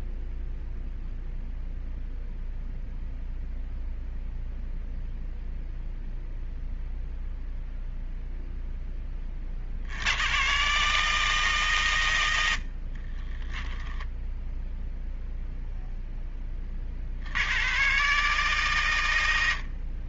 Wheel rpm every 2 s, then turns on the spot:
0, 0, 0, 0, 20, 150, 40, 0, 50, 100.
12-14